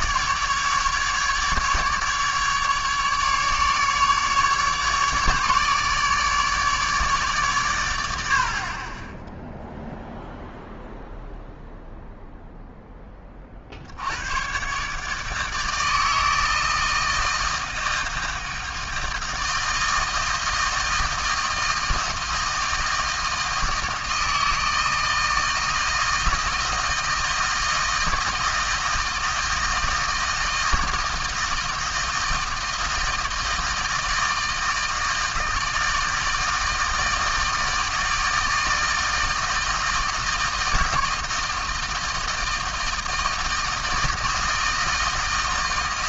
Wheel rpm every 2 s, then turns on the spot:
150, 150, 150, 150, 40, 0, 0, 130, 160, 160, 160, 160, 160, 160, 160, 160, 160, 160, 160, 160, 160, 160, 160.
none